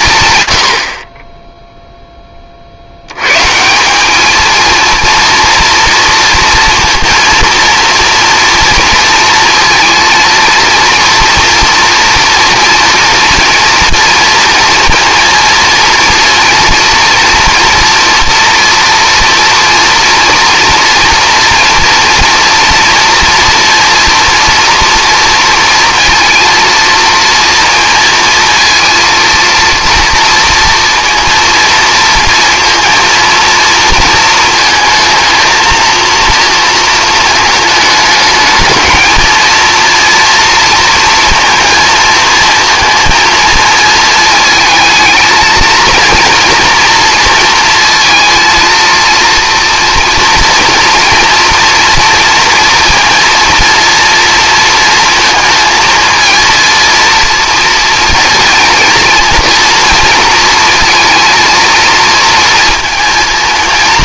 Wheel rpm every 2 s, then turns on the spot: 80, 60, 230, 230, 230, 230, 240, 230, 230, 240, 230, 230, 230, 230, 230, 230, 230, 220, 230, 220, 230, 230, 220, 230, 230, 230, 230, 230, 230, 230, 230, 230.
none